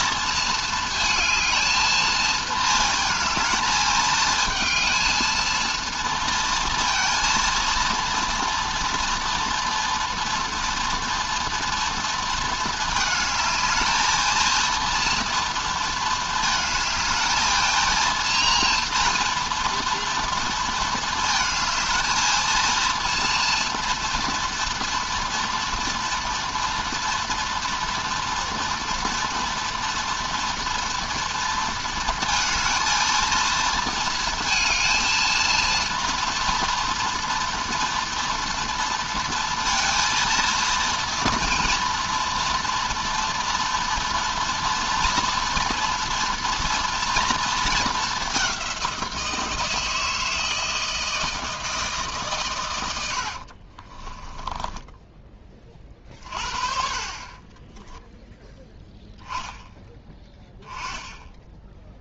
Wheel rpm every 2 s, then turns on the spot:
230, 220, 230, 230, 230, 230, 220, 230, 220, 230, 220, 230, 230, 240, 230, 230, 220, 230, 230, 230, 230, 230, 230, 230, 180, 160, 100, 10, 40, 0, 10.
54-56